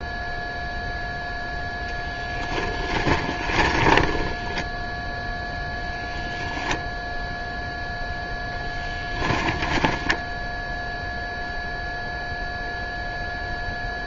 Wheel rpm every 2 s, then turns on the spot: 0, 10, 0, 0, 10, 0, 0.
2-4 8-10